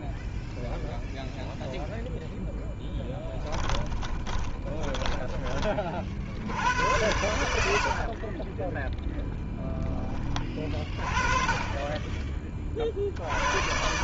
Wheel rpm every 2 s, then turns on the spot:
0, 10, 20, 100, 20, 20, 30.
4-6 8-10